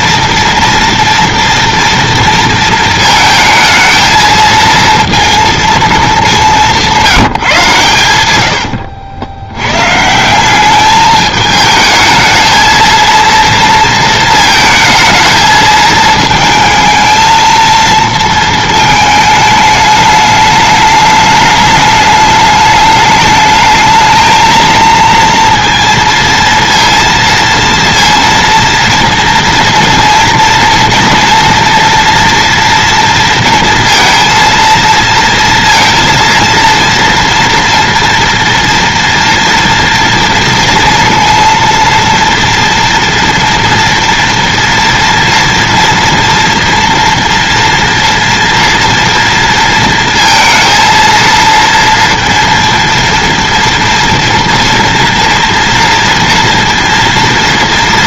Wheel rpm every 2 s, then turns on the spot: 230, 230, 230, 180, 80, 200, 230, 220, 220, 220, 210, 210, 230, 230, 230, 230, 230, 230, 230, 240, 230, 230, 240, 230, 240, 230, 230, 230, 230.
8-10